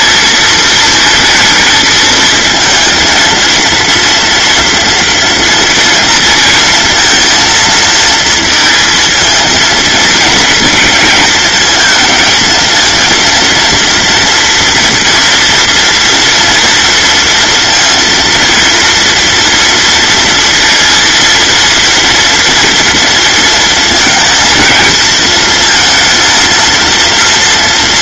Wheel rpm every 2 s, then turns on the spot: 230, 230, 240, 230, 220, 220, 230, 230, 230, 230, 230, 230, 230, 230.
none